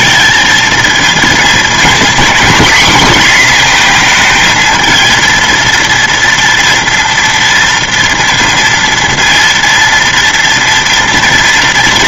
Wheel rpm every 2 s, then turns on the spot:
230, 240, 220, 230, 230, 230.
none